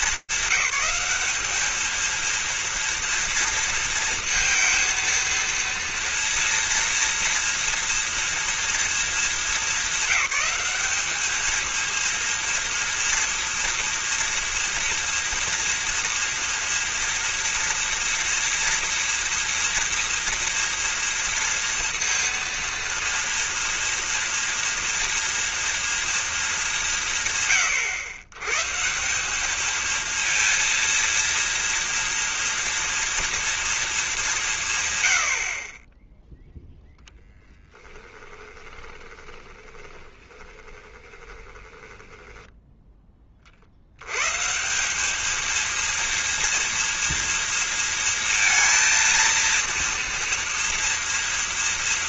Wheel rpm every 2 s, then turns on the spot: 210, 230, 230, 230, 230, 210, 230, 230, 230, 230, 230, 230, 230, 160, 170, 230, 230, 90, 10, 20, 20, 20, 200, 230, 230, 230.
38-42